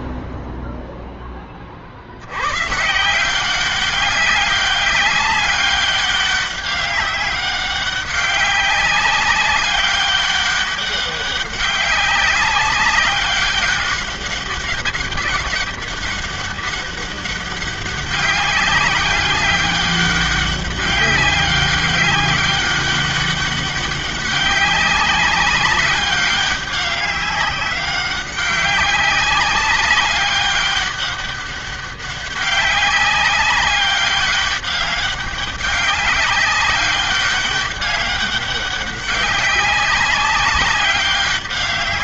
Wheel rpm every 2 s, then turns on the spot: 0, 100, 200, 200, 190, 200, 200, 200, 200, 190, 200, 200, 200, 200, 190, 200, 200, 200, 200, 200, 190.
none